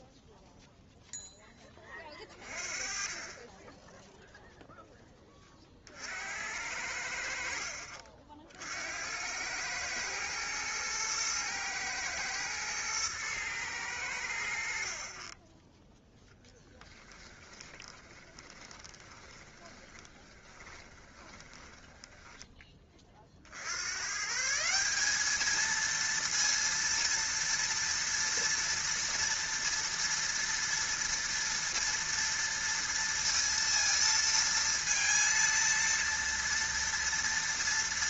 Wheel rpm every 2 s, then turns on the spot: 0, 30, 0, 80, 60, 110, 110, 80, 10, 20, 20, 10, 160, 230, 230, 230, 230, 230, 230.
16-24